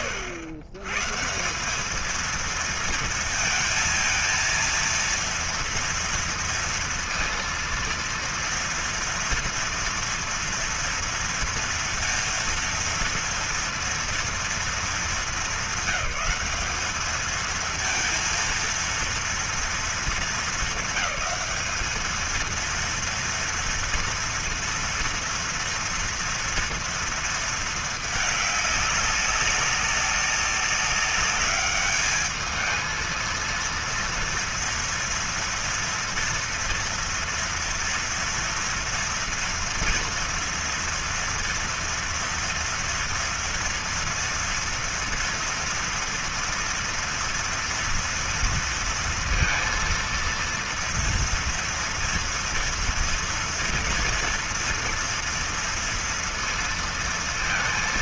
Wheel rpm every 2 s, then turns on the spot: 120, 230, 230, 230, 230, 230, 230, 230, 220, 230, 210, 230, 230, 230, 200, 200, 220, 240, 240, 230, 230, 230, 240, 230, 230, 230, 230, 230, 230.
none